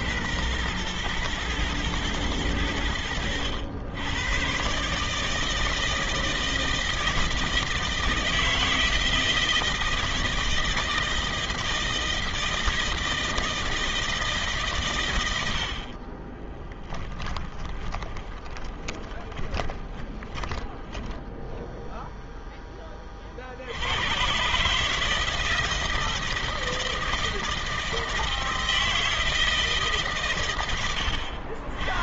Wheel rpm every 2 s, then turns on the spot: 120, 90, 150, 160, 160, 160, 160, 100, 10, 20, 10, 40, 160, 160, 160, 80.
14-22